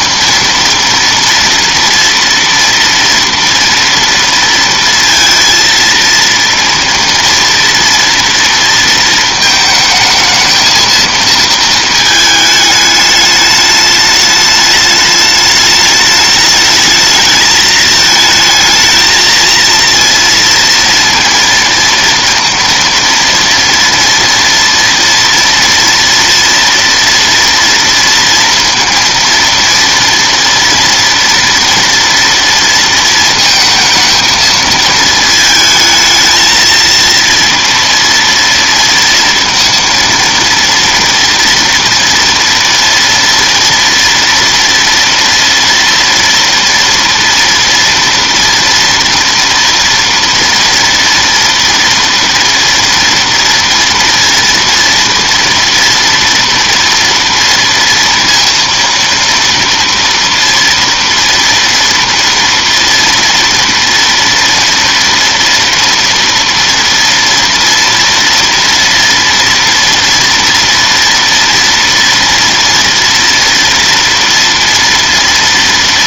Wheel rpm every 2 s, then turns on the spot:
230, 230, 230, 230, 230, 220, 210, 210, 220, 220, 230, 230, 230, 230, 230, 230, 230, 220, 220, 230, 230, 230, 230, 230, 230, 230, 230, 230, 240, 230, 230, 230, 230, 230, 230, 230, 230, 230.
none